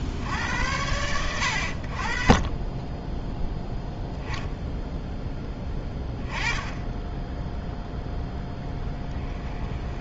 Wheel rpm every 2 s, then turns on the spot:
100, 30, 0, 10, 10.
8-10